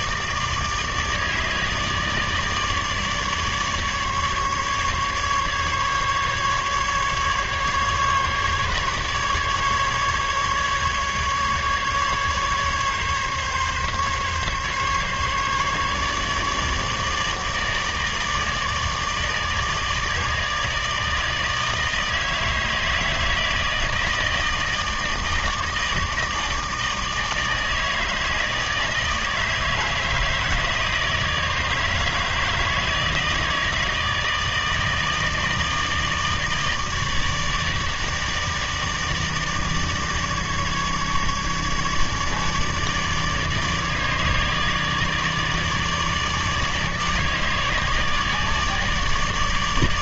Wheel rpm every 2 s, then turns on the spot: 150, 150, 150, 150, 150, 150, 140, 140, 150, 150, 150, 160, 160, 160, 160, 160, 160, 160, 160, 160, 150, 150, 150, 150, 150.
none